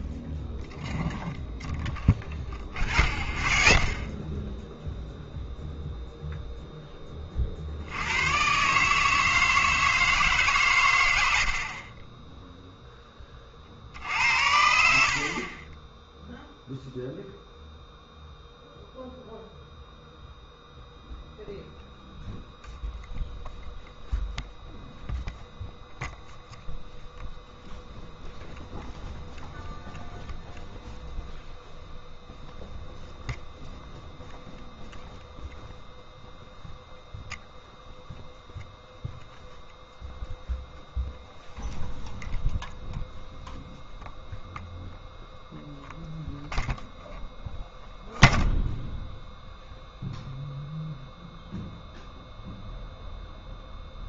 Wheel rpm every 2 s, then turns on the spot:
0, 0, 0, 10, 150, 110, 10, 70, 0, 0, 0, 0, 0, 0, 0, 0, 0, 0, 0, 0, 0, 0, 0, 0, 0, 0, 0.
none